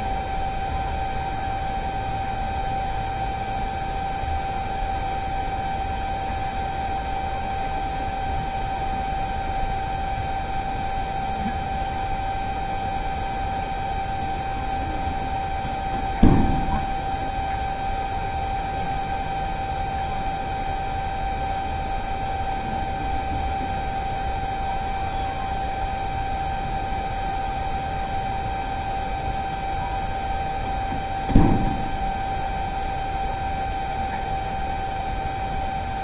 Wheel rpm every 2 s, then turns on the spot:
0, 0, 0, 0, 0, 0, 0, 0, 0, 0, 0, 0, 0, 0, 0, 0, 0, 0.
none